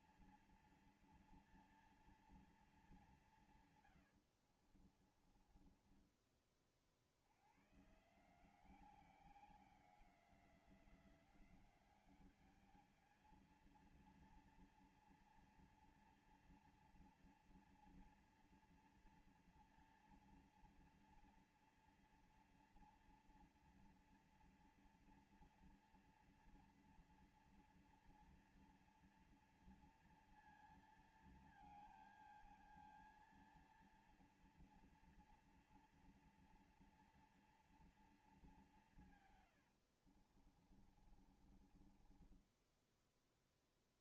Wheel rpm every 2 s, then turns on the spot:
230, 220, 80, 40, 160, 180, 210, 230, 230, 230, 230, 230, 230, 230, 230, 230, 220, 230, 230, 210, 50, 20.
4-6 40-44